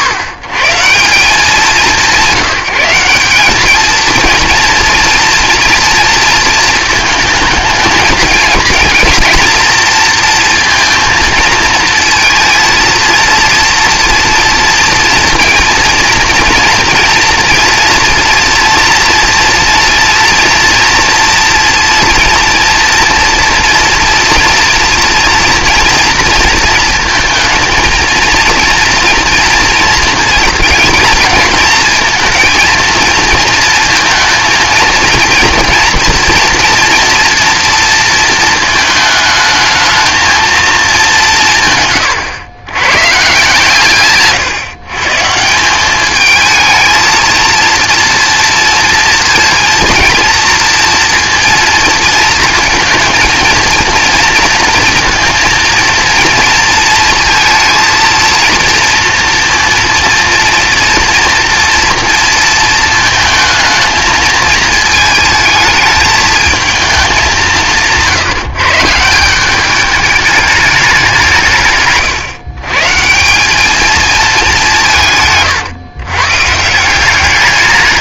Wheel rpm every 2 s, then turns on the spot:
100, 180, 230, 230, 230, 230, 230, 230, 230, 240, 240, 230, 230, 230, 230, 220, 230, 230, 240, 220, 220, 110, 140, 220, 230, 230, 230, 230, 230, 230, 230, 230, 220, 220, 150, 210, 140, 190, 170.
none